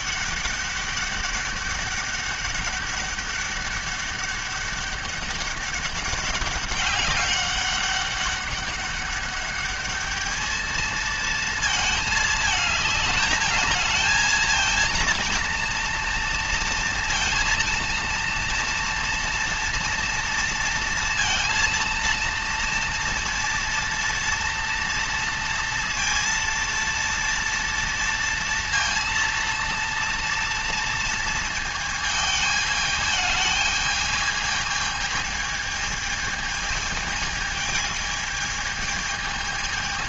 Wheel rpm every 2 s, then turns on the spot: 200, 200, 200, 200, 200, 220, 220, 230, 230, 230, 230, 230, 230, 230, 230, 230, 220, 220, 220, 220.
none